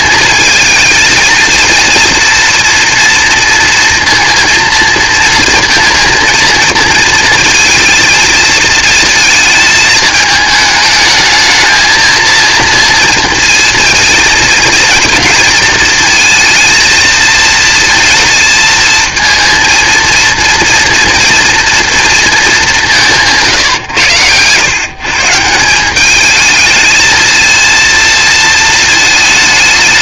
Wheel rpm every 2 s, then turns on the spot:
230, 230, 230, 220, 220, 210, 230, 230, 230, 230, 240, 200, 120, 220, 220.
none